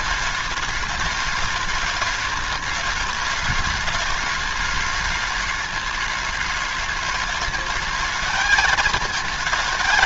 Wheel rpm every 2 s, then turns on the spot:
210, 210, 210, 210, 220.
none